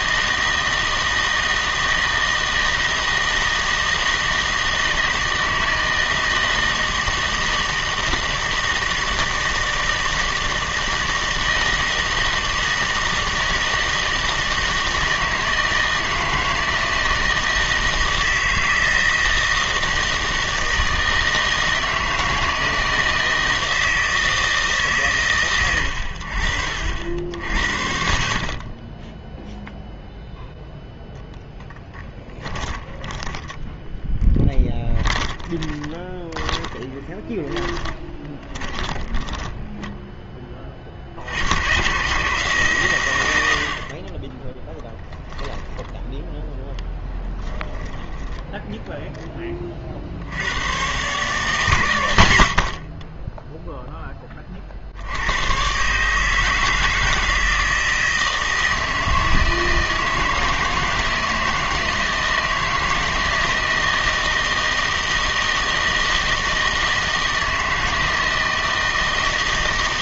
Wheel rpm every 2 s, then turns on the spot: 160, 160, 160, 160, 160, 160, 160, 160, 160, 160, 160, 160, 150, 70, 30, 10, 20, 20, 20, 30, 40, 140, 10, 10, 10, 100, 70, 40, 160, 160, 160, 160, 160, 160, 160.
32-40 48-50